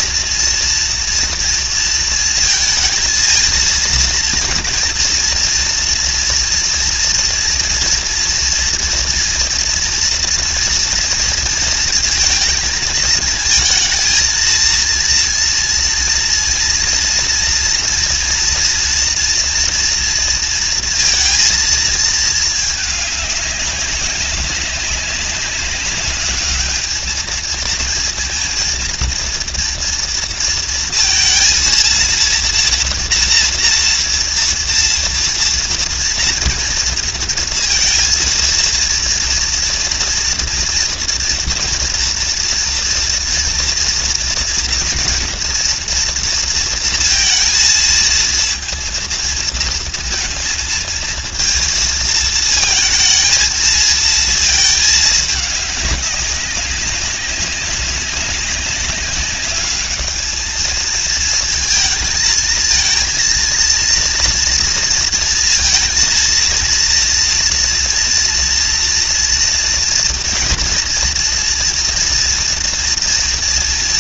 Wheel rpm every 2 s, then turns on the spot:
230, 230, 240, 230, 230, 230, 220, 230, 230, 240, 230, 210, 200, 220, 230, 230, 230, 230, 230, 230, 240, 230, 230, 230, 230, 230, 230, 210, 190, 200, 220, 230, 230, 230, 230, 230, 230.
none